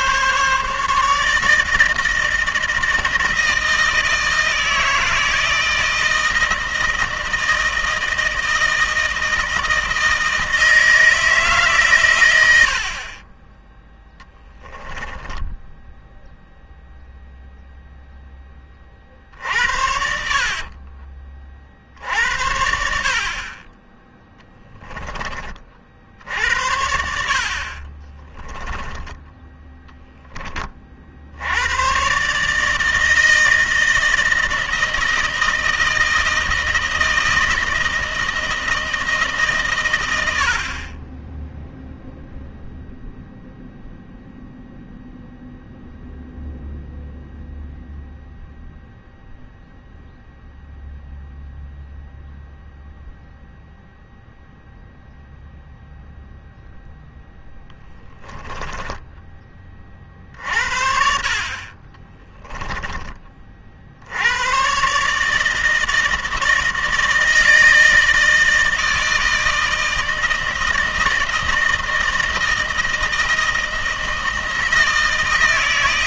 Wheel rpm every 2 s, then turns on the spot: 150, 160, 160, 160, 160, 160, 60, 10, 0, 30, 40, 60, 10, 70, 20, 40, 160, 160, 160, 160, 30, 0, 0, 0, 0, 0, 0, 0, 0, 10, 50, 30, 120, 160, 160, 160, 160, 160.
14-16 20-22